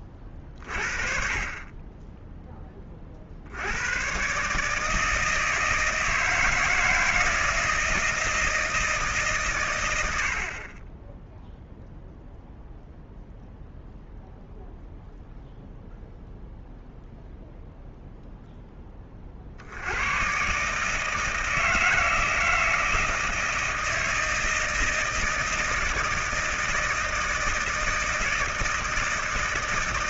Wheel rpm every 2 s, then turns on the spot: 30, 20, 140, 160, 160, 50, 0, 0, 0, 0, 140, 160, 160, 160, 160.
none